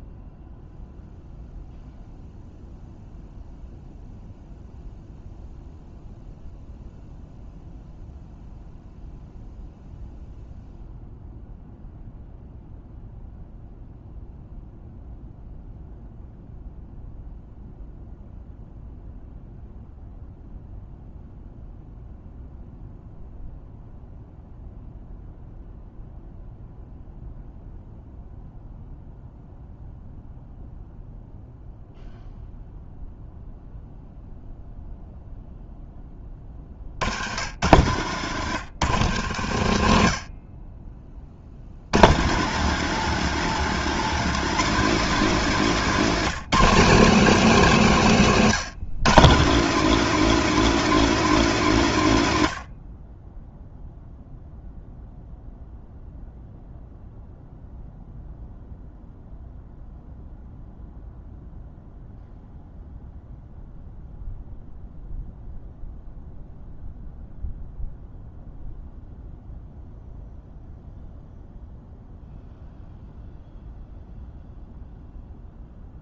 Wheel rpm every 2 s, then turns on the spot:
0, 0, 0, 0, 0, 0, 0, 0, 0, 0, 0, 0, 0, 0, 0, 0, 0, 0, 60, 110, 30, 170, 210, 200, 160, 230, 50, 0, 0, 0, 0, 0, 0, 0, 0, 0, 0, 0.
none